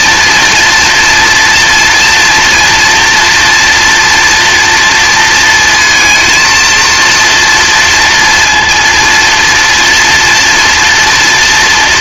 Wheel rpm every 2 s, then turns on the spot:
230, 240, 240, 230, 230, 230.
none